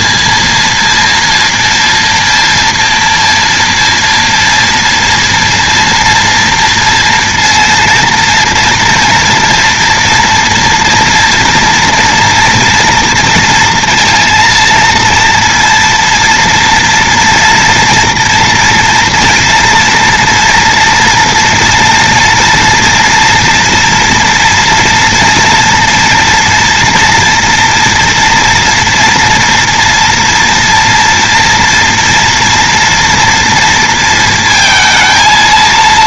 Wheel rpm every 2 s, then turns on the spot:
230, 230, 230, 230, 230, 230, 230, 230, 230, 240, 240, 230, 230, 230, 230, 230, 230, 220.
none